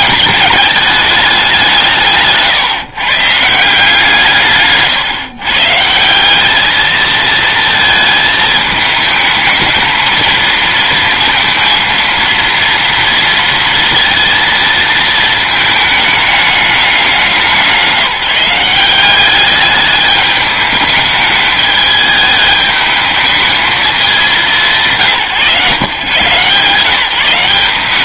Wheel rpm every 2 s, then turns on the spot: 210, 140, 140, 210, 220, 230, 230, 230, 210, 190, 210, 210, 180, 150.
none